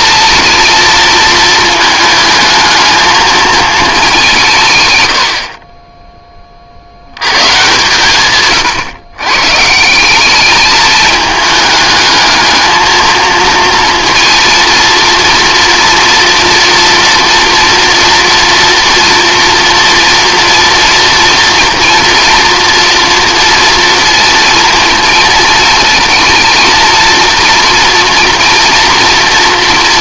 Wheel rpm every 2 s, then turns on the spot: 230, 220, 130, 50, 120, 210, 220, 230, 230, 230, 240, 230, 230, 230, 240.
none